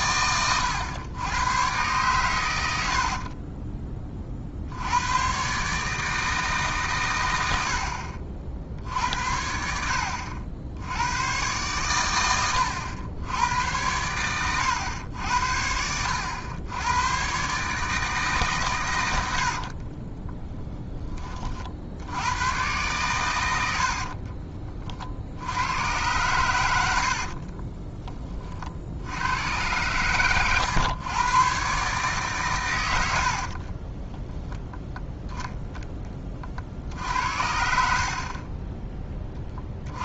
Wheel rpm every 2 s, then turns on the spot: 100, 80, 80, 140, 60, 90, 100, 100, 100, 110, 10, 120, 40, 80, 70, 120, 110, 10, 60, 20.
26-28 32-34 38-40